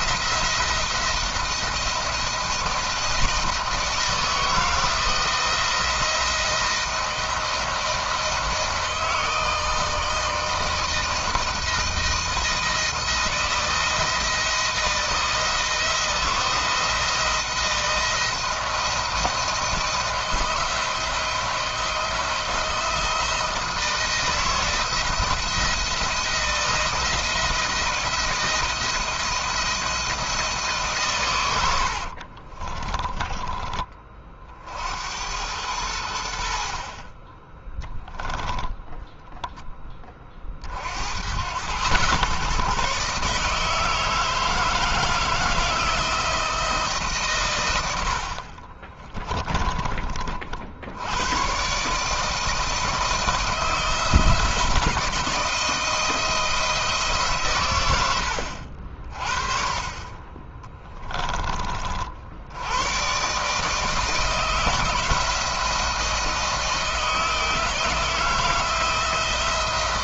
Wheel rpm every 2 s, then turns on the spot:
160, 160, 160, 160, 160, 160, 160, 170, 170, 170, 170, 170, 170, 170, 170, 150, 50, 50, 70, 10, 40, 130, 160, 160, 50, 50, 160, 170, 160, 70, 20, 80, 160, 160, 160.
32-34 38-40 48-50 60-62